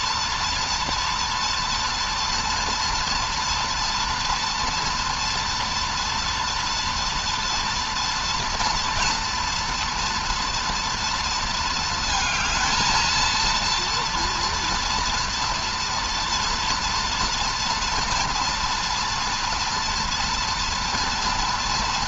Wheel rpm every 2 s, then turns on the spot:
230, 240, 230, 230, 230, 230, 230, 230, 240, 230, 240.
none